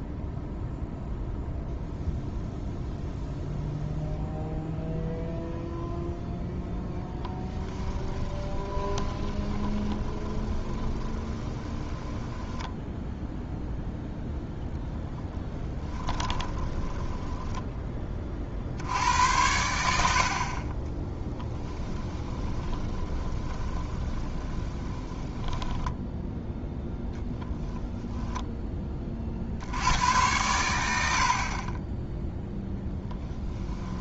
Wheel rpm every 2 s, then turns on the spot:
0, 0, 0, 10, 20, 20, 10, 10, 10, 70, 30, 20, 20, 10, 20, 90, 10.
6-14 16-18 20-26 32-34